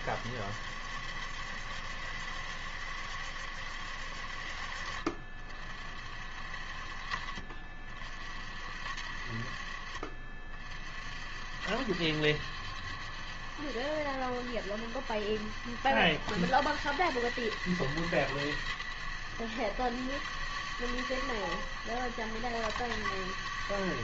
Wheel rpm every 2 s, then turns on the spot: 70, 70, 50, 50, 60, 60, 80, 70, 90, 80, 90, 90.
none